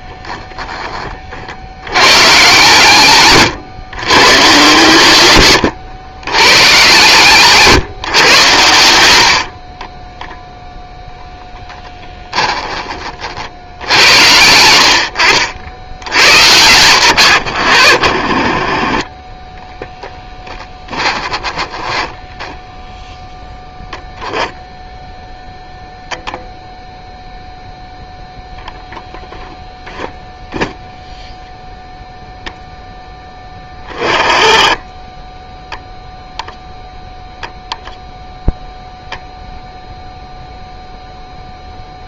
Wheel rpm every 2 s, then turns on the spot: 20, 130, 120, 130, 100, 0, 30, 70, 120, 30, 20, 0, 0, 0, 0, 0, 0, 10, 0, 0, 0.
8-10 14-16 20-22